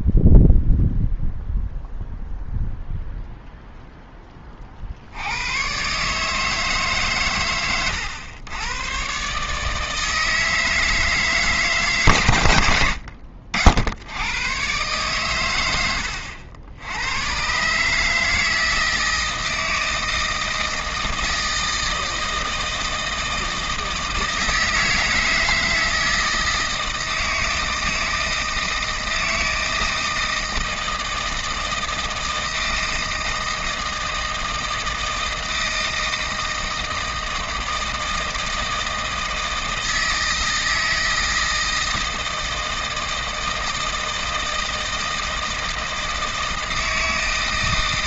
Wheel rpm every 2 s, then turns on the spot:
0, 0, 30, 150, 110, 160, 90, 110, 90, 160, 160, 160, 160, 160, 160, 160, 160, 160, 160, 160, 160, 160, 160, 160.
none